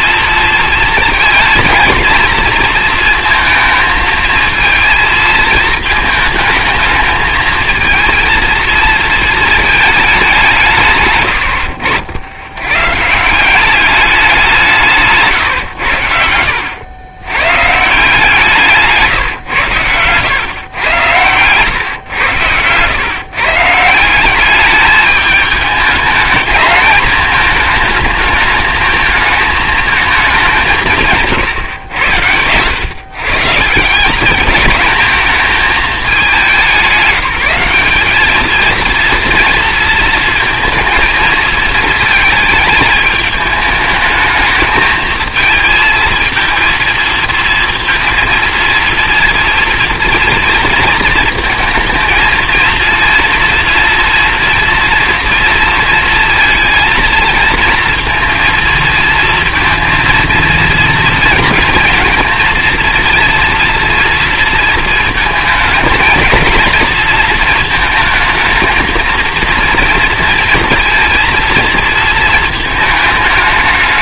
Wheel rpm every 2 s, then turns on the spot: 230, 220, 220, 220, 220, 100, 180, 140, 110, 140, 120, 140, 210, 210, 220, 140, 140, 220, 190, 230, 220, 210, 220, 230, 230, 220, 230, 240, 220, 230, 230, 230, 220, 230, 230, 230, 220.
18-20